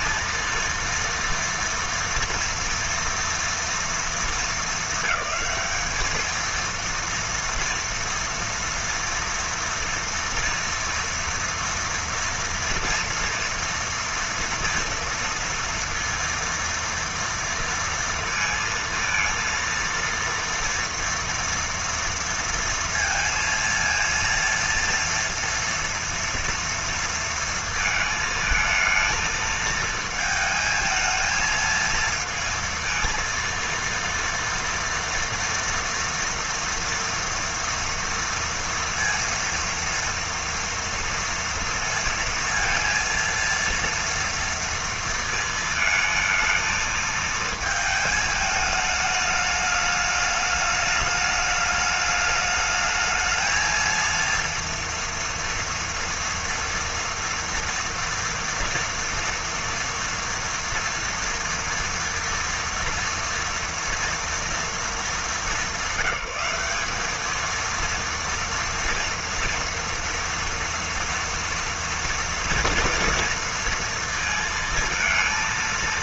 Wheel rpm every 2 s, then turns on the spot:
230, 230, 200, 230, 230, 230, 230, 230, 230, 230, 230, 230, 230, 230, 220, 220, 230, 230, 230, 230, 230, 230, 230, 220, 210, 210, 220, 240, 230, 230, 230, 230, 200, 200, 230, 240, 230, 220.
none